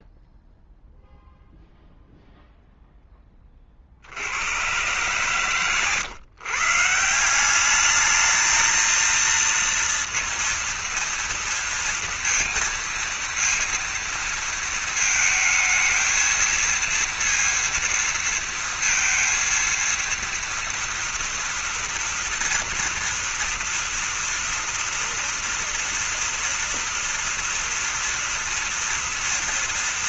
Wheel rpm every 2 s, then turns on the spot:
0, 0, 90, 140, 220, 230, 230, 230, 230, 230, 230, 230, 230, 230, 240.
none